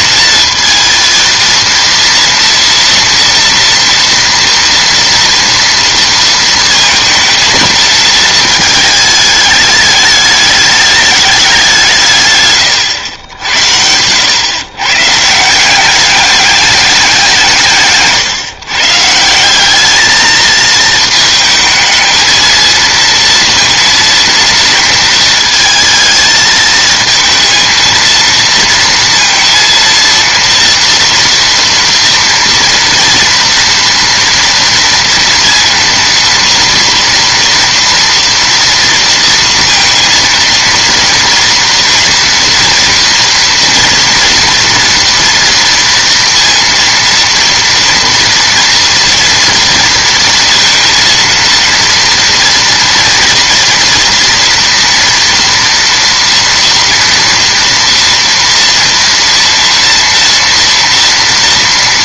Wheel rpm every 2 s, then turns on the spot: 230, 230, 240, 220, 220, 210, 130, 130, 200, 140, 220, 230, 230, 220, 230, 230, 230, 230, 230, 230, 230, 230, 230, 230, 230, 230, 230, 230, 230, 230, 230.
none